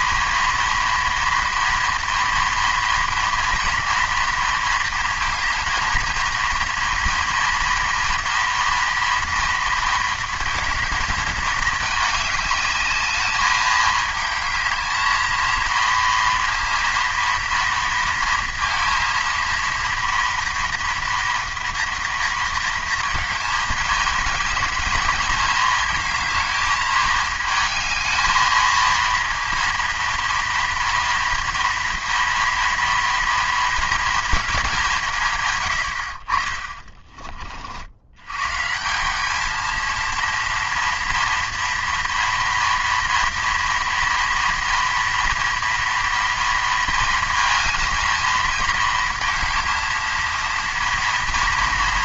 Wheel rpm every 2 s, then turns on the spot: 230, 230, 230, 230, 230, 230, 210, 220, 230, 230, 230, 230, 220, 220, 220, 230, 230, 210, 40, 150, 230, 230, 230, 230, 230, 230.
36-38